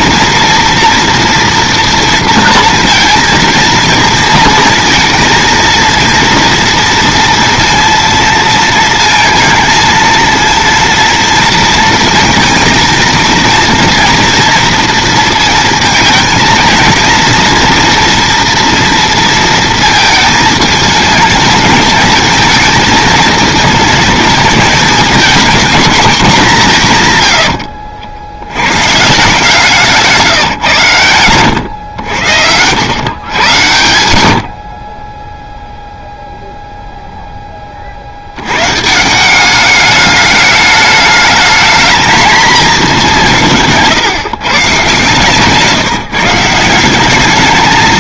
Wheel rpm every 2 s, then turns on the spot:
240, 230, 230, 230, 230, 230, 230, 230, 230, 230, 220, 220, 220, 170, 130, 120, 110, 40, 0, 130, 210, 210, 140, 180.
none